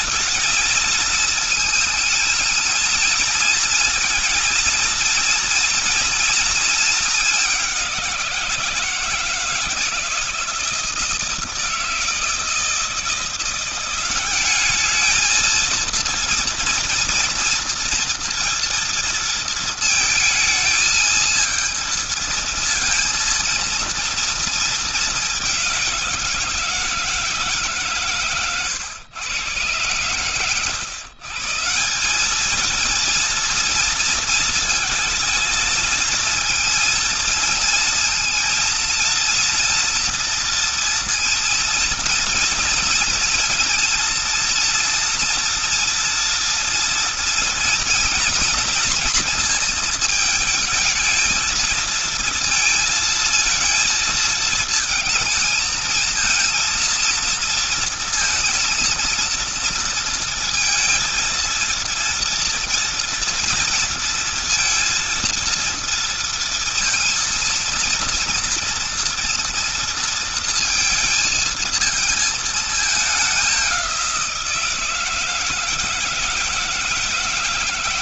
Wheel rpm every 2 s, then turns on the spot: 220, 220, 230, 220, 170, 160, 160, 210, 230, 230, 220, 230, 220, 170, 120, 140, 220, 230, 230, 230, 230, 230, 230, 230, 240, 220, 220, 220, 230, 230, 230, 230, 230, 230, 230, 230, 210, 170, 160.
none